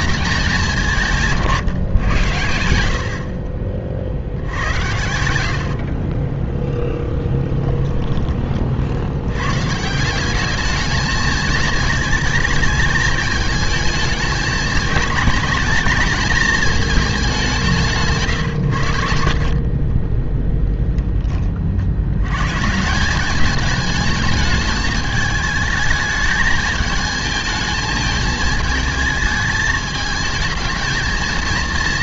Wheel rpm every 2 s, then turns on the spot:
200, 90, 80, 10, 30, 210, 220, 210, 220, 120, 20, 140, 210, 220, 210, 220.
4-8 18-20